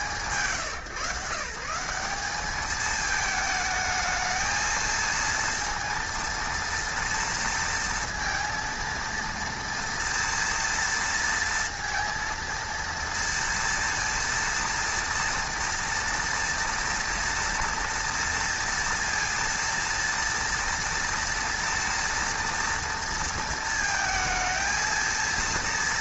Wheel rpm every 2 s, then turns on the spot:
140, 210, 230, 230, 230, 230, 230, 230, 240, 230, 230, 230, 230.
none